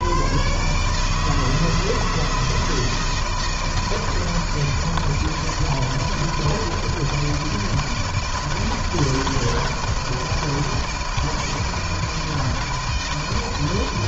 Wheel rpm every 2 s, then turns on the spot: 130, 160, 160, 160, 160, 160, 160.
none